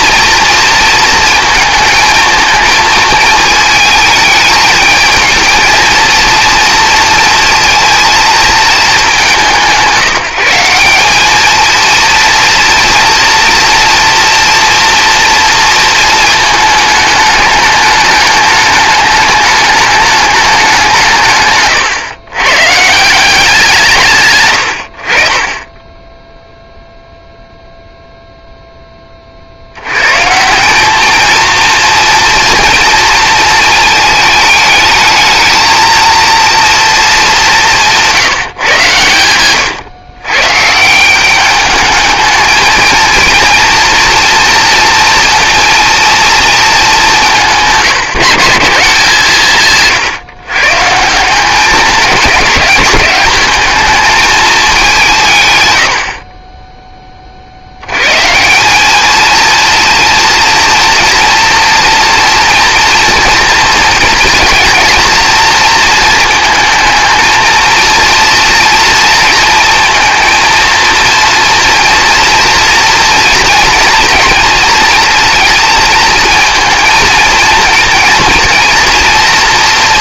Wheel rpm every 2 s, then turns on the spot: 230, 220, 220, 230, 200, 200, 230, 230, 210, 210, 150, 170, 60, 0, 10, 200, 240, 220, 230, 130, 150, 230, 230, 210, 160, 140, 200, 200, 20, 180, 240, 230, 230, 220, 230, 230, 230, 230, 220, 230.
none